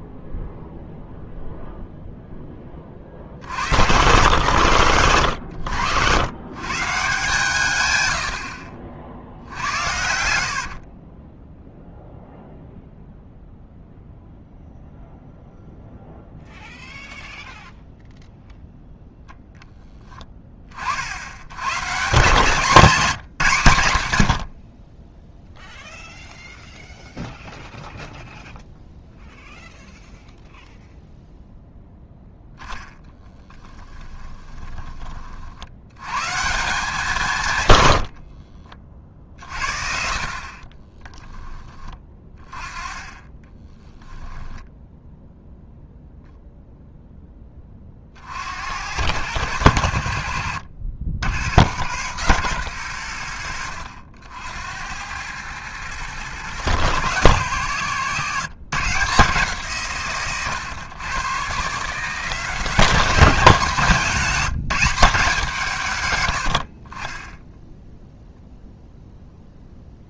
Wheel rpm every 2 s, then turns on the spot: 0, 20, 130, 140, 50, 50, 0, 0, 0, 0, 40, 200, 60, 0, 0, 0, 10, 20, 180, 50, 30, 30, 10, 0, 100, 80, 120, 80, 140, 160, 130, 180, 180, 50, 0.
10-12 34-36 38-42 44-46